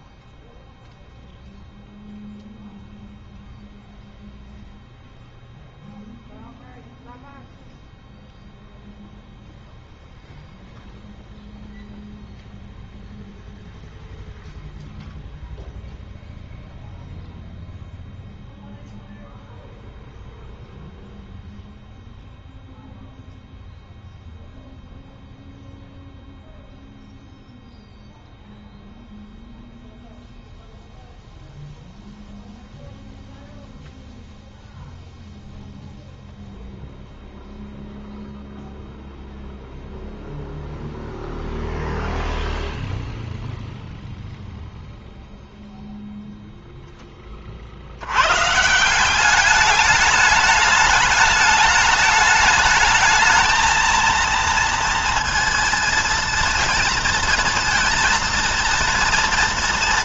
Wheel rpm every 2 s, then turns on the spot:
0, 0, 0, 0, 0, 0, 0, 0, 0, 0, 0, 0, 0, 0, 0, 0, 0, 0, 0, 0, 0, 0, 0, 0, 130, 210, 210, 230, 230, 230.
none